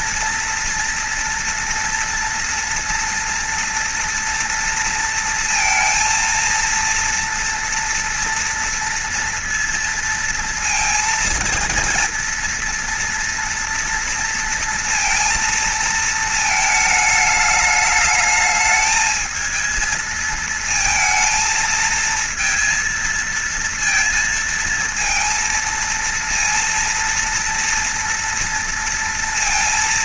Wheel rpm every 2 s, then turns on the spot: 230, 230, 230, 230, 230, 230, 240, 230, 220, 220, 220, 230, 230, 230, 230.
none